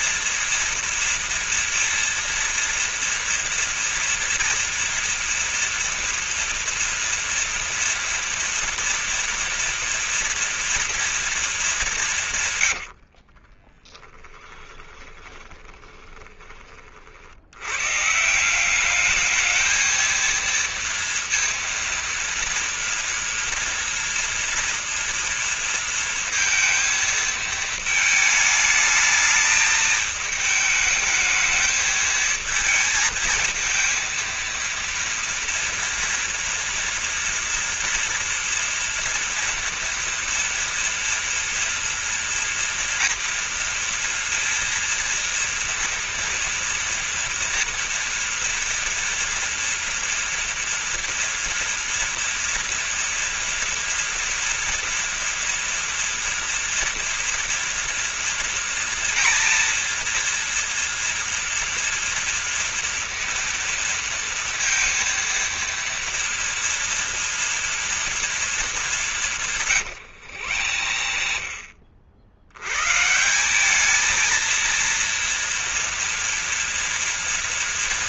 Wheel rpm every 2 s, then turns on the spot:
230, 230, 230, 240, 240, 230, 100, 20, 40, 200, 230, 230, 230, 220, 220, 220, 220, 230, 230, 240, 230, 230, 230, 230, 230, 240, 230, 240, 230, 230, 230, 230, 230, 240, 210, 80, 120, 230, 240.
12-16 70-72